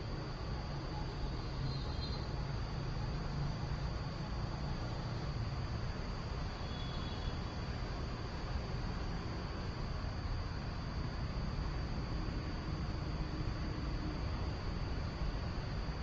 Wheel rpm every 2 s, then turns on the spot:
0, 0, 0, 0, 0, 0, 0, 0.
none